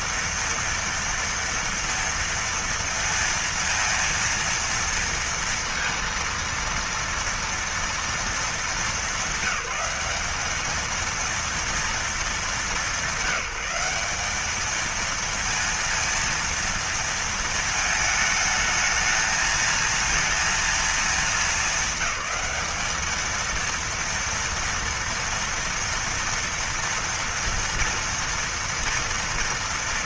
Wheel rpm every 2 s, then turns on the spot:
230, 230, 230, 230, 210, 210, 210, 220, 230, 220, 230, 210, 230, 230, 230.
none